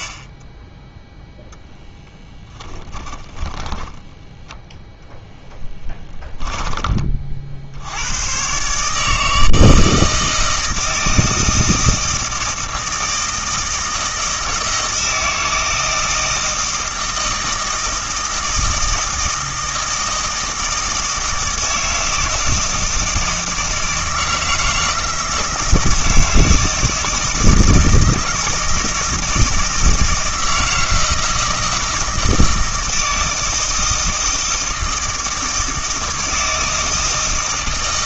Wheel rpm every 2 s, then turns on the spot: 10, 10, 0, 20, 140, 160, 160, 160, 160, 160, 160, 160, 160, 160, 160, 160, 160, 160, 160.
2-4